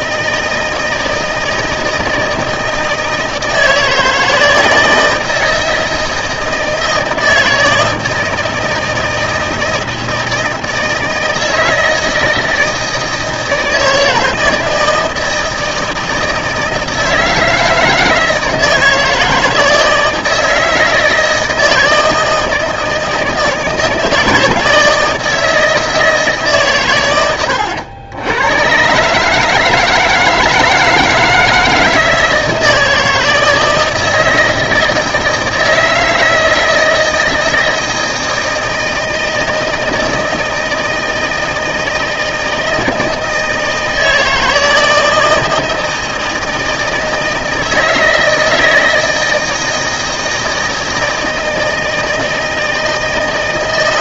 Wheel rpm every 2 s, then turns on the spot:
160, 160, 160, 160, 160, 160, 160, 160, 160, 160, 160, 160, 160, 140, 110, 160, 160, 160, 160, 160, 160, 160, 160, 160, 160, 160, 160.
none